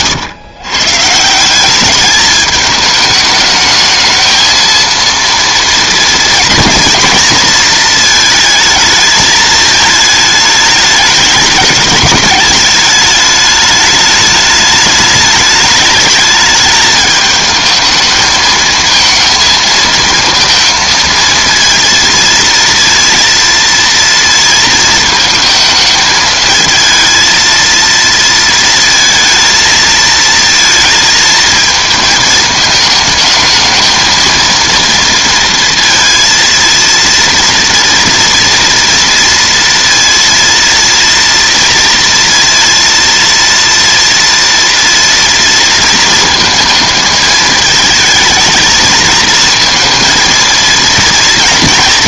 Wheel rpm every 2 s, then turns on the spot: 120, 210, 220, 230, 220, 210, 210, 210, 210, 220, 230, 230, 230, 220, 230, 230, 220, 230, 230, 230, 230, 230, 230, 220, 220, 230.
none